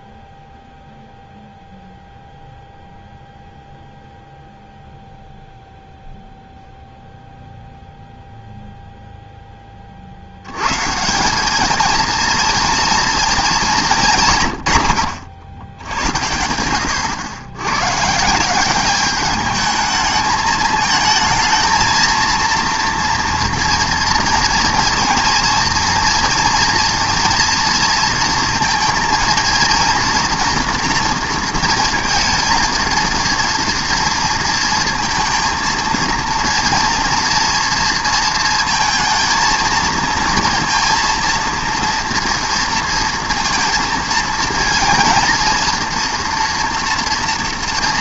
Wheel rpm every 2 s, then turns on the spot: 0, 0, 0, 0, 0, 110, 230, 120, 90, 180, 220, 230, 230, 230, 230, 240, 230, 230, 230, 230, 230, 230, 230, 230.
none